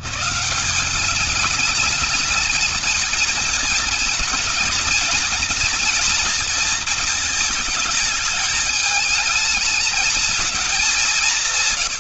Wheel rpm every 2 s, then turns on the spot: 180, 220, 230, 230, 210, 200.
none